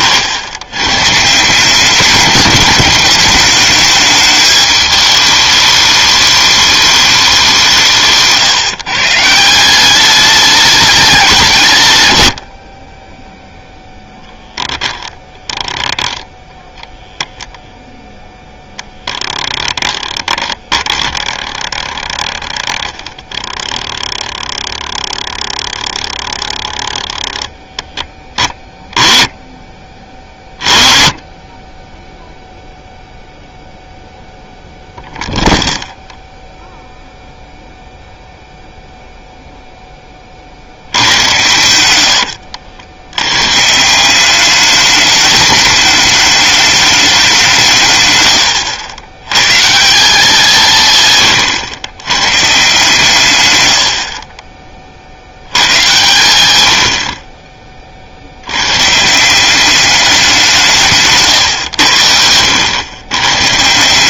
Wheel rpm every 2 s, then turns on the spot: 90, 200, 210, 210, 140, 200, 40, 0, 0, 0, 10, 10, 10, 10, 10, 30, 0, 0, 0, 0, 70, 80, 210, 210, 80, 170, 160, 30, 80, 110, 160, 100.
none